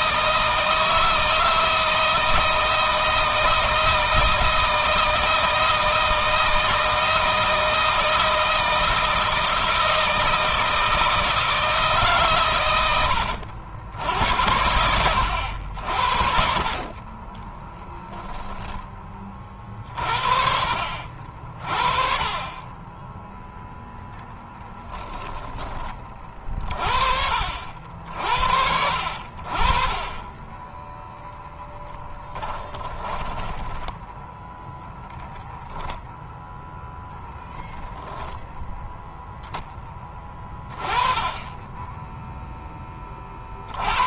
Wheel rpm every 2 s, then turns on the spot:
160, 160, 160, 160, 160, 160, 120, 90, 50, 10, 50, 20, 20, 40, 50, 10, 20, 0, 0, 10, 10, 0.
24-26 32-34